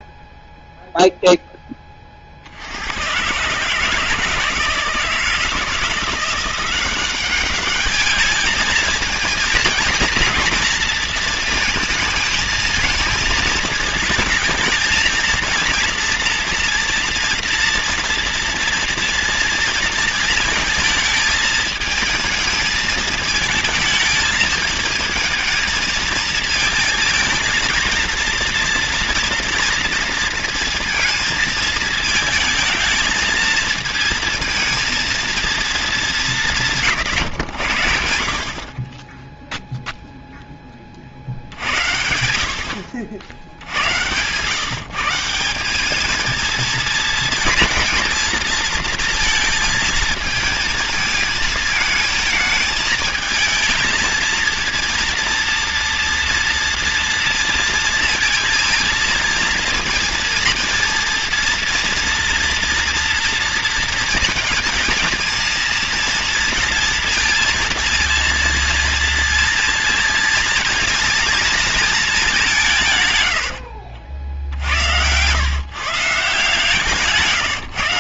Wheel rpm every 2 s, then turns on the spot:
0, 70, 160, 180, 220, 230, 220, 220, 230, 230, 220, 220, 220, 230, 230, 230, 220, 220, 170, 50, 10, 80, 140, 230, 230, 220, 220, 230, 230, 230, 230, 230, 220, 230, 230, 230, 170, 70, 160.
none